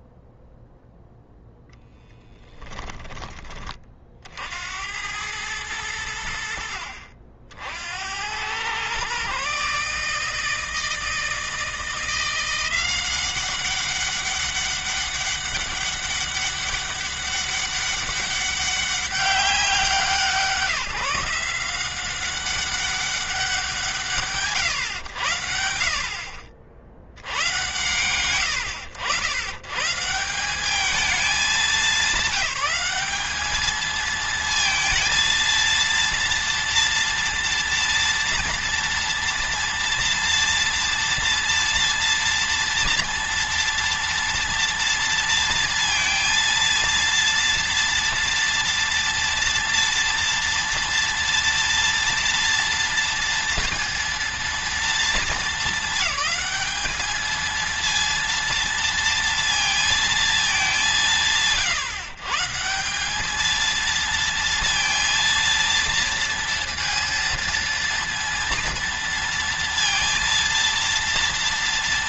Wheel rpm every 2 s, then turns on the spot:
0, 10, 80, 60, 120, 160, 180, 200, 200, 200, 160, 200, 100, 70, 100, 210, 210, 220, 230, 230, 230, 230, 230, 230, 230, 230, 230, 230, 220, 230, 170, 190, 230, 230, 230, 230.
none